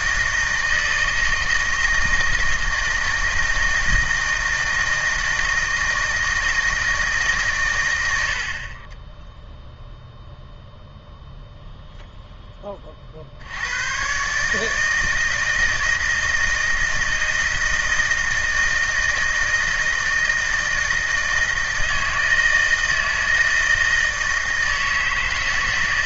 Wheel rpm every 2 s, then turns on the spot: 160, 160, 160, 160, 40, 0, 20, 150, 160, 160, 160, 160, 160.
none